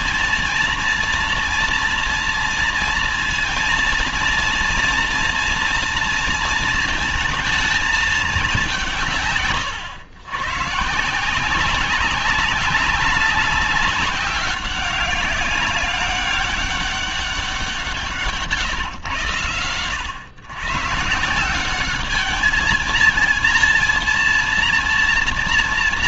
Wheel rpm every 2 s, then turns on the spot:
230, 230, 230, 230, 190, 120, 200, 190, 200, 150, 120, 220, 230.
none